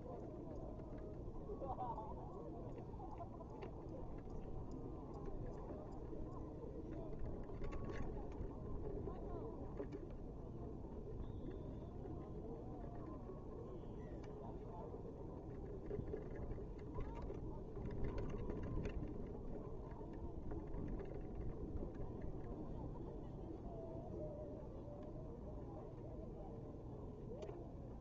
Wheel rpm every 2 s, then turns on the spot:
0, 0, 0, 0, 0, 0, 0, 0, 0, 0, 0, 0, 0, 0.
none